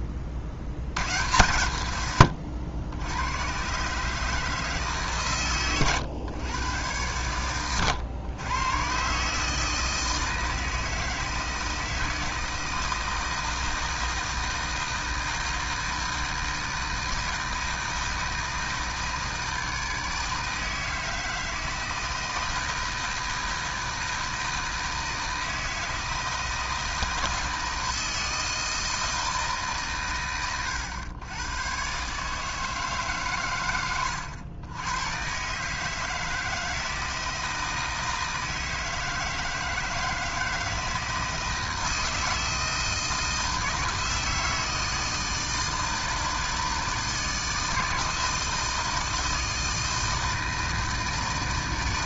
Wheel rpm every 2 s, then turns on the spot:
100, 90, 140, 110, 120, 160, 160, 160, 160, 160, 160, 160, 160, 160, 160, 110, 140, 110, 160, 160, 160, 160, 160, 160, 160, 160.
none